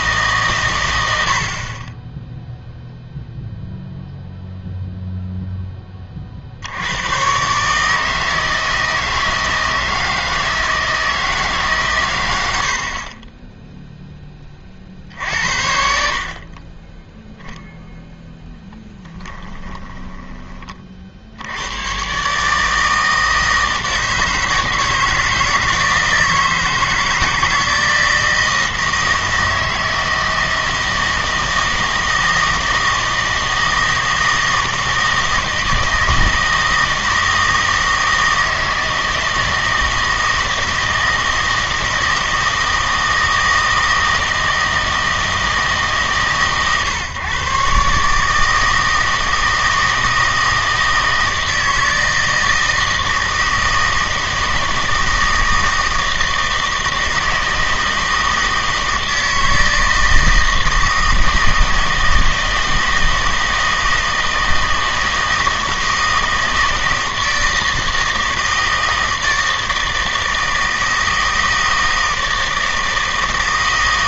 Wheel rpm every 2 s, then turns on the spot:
130, 0, 0, 70, 160, 160, 80, 30, 30, 10, 30, 150, 160, 160, 160, 160, 160, 160, 160, 160, 160, 160, 160, 140, 160, 160, 160, 160, 160, 160, 160, 160, 160, 160, 160, 160, 160.
none